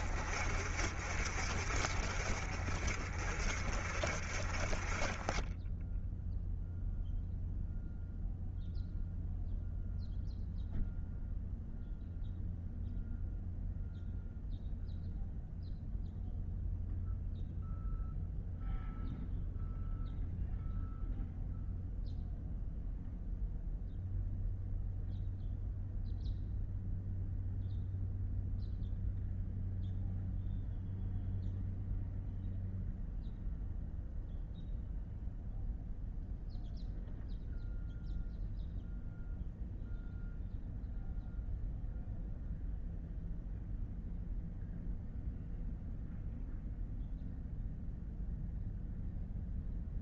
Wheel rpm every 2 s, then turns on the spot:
50, 40, 30, 0, 0, 0, 0, 0, 0, 0, 0, 0, 0, 0, 0, 0, 0, 0, 0, 0, 0, 0, 0, 0, 0.
none